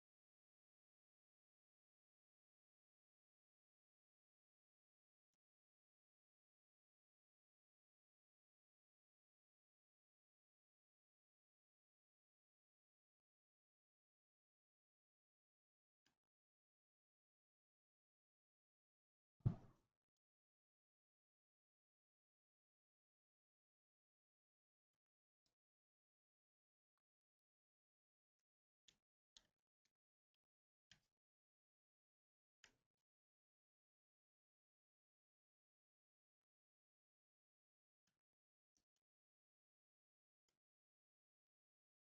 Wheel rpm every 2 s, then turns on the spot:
0, 0, 0, 0, 0, 0, 0, 0, 0, 0, 0, 0, 0, 0, 0, 0, 0, 0, 0, 0, 0.
none